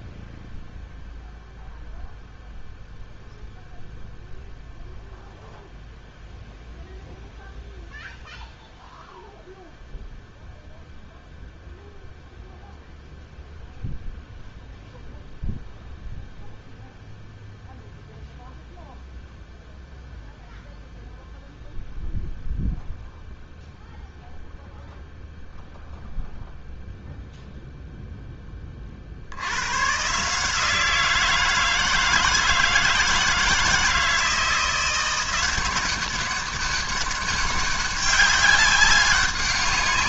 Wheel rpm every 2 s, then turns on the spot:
0, 0, 0, 0, 0, 0, 0, 0, 0, 0, 0, 0, 0, 0, 10, 160, 160, 170, 200, 200.
none